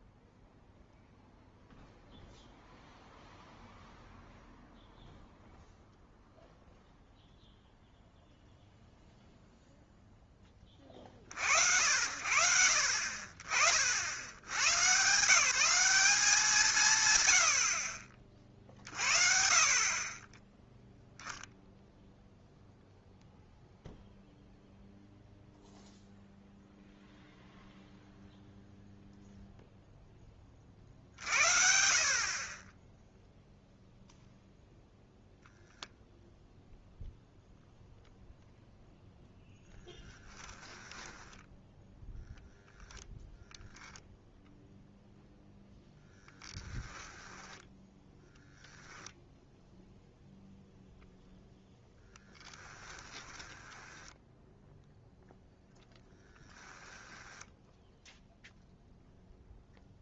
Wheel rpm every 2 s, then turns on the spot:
0, 0, 0, 0, 0, 20, 70, 100, 160, 40, 10, 0, 0, 0, 0, 40, 20, 0, 0, 0, 10, 0, 0, 10, 0, 0, 10, 0, 10, 0.
40-42 46-48 52-54 56-58